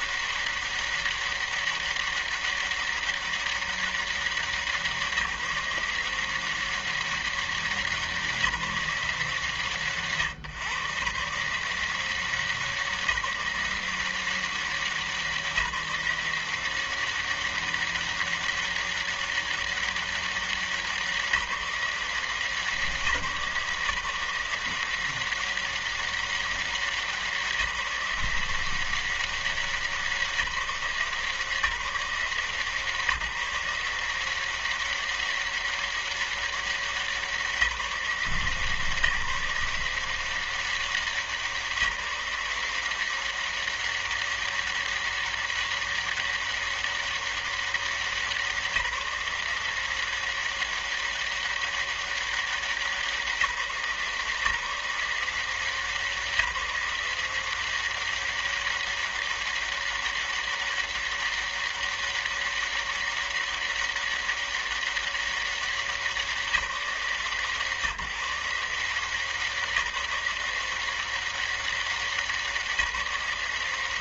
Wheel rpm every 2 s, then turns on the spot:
190, 200, 190, 180, 180, 120, 180, 180, 180, 200, 200, 170, 160, 200, 170, 180, 160, 170, 200, 160, 170, 170, 200, 200, 190, 190, 200, 170, 180, 190, 200, 200, 200, 190, 150, 170, 190.
none